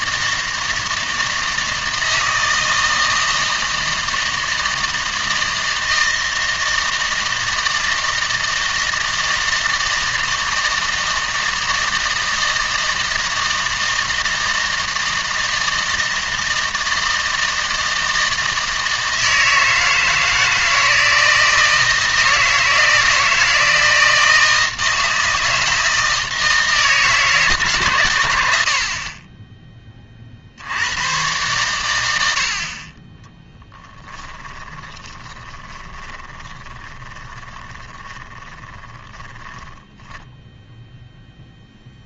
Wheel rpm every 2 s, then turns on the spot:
160, 160, 160, 160, 160, 160, 160, 160, 160, 160, 160, 160, 160, 160, 80, 60, 60, 20, 20, 10, 0.
34-40